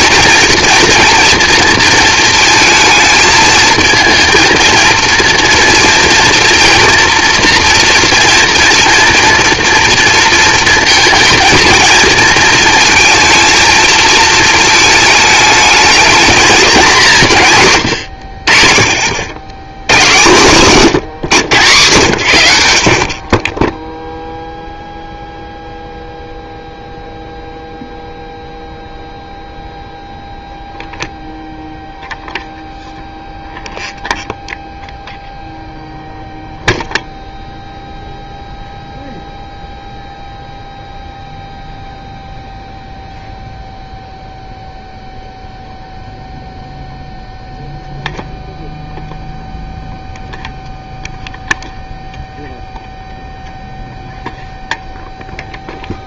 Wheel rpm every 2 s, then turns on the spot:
230, 220, 230, 230, 230, 230, 220, 220, 220, 60, 150, 70, 0, 0, 0, 0, 0, 0, 0, 0, 0, 0, 0, 0, 0, 0, 0, 0.
20-22